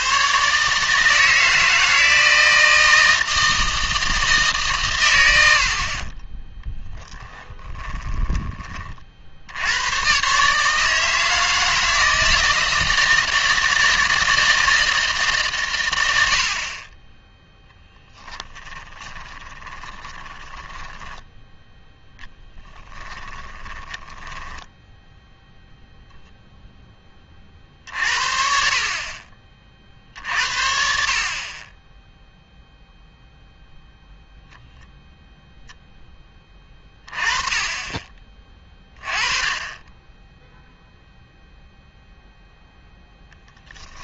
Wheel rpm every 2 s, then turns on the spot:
140, 160, 130, 10, 30, 150, 160, 160, 40, 20, 20, 20, 10, 0, 50, 60, 0, 0, 20, 20, 0, 0.
18-26